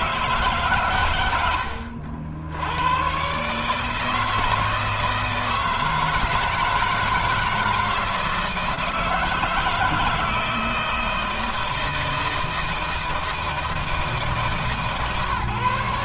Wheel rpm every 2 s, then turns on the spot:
130, 100, 160, 160, 160, 160, 160, 150.
none